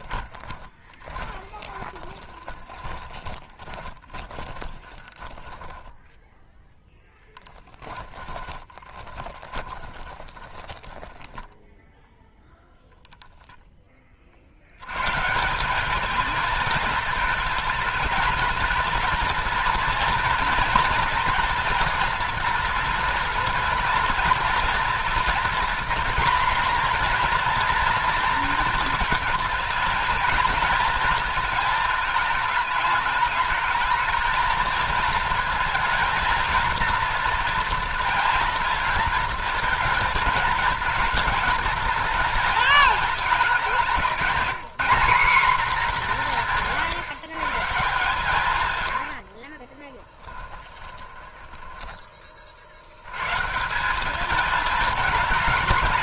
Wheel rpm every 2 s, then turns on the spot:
20, 20, 30, 10, 20, 10, 0, 110, 230, 230, 230, 230, 230, 240, 220, 220, 210, 220, 230, 230, 220, 220, 210, 150, 90, 20, 60, 220.
0-12 48-52